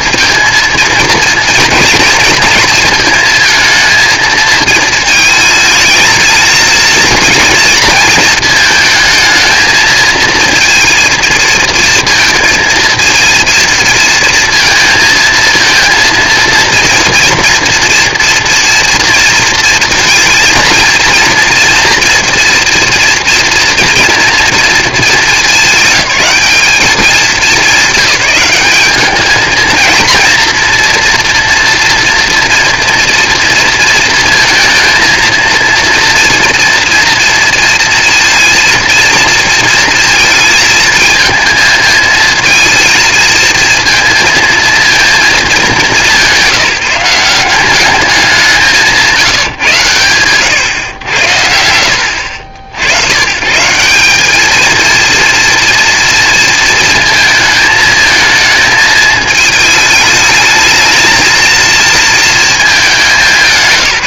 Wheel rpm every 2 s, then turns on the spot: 230, 230, 220, 230, 220, 230, 230, 230, 230, 230, 230, 230, 240, 210, 200, 230, 240, 230, 230, 230, 220, 230, 230, 180, 190, 110, 80, 220, 230, 220, 220, 210.
none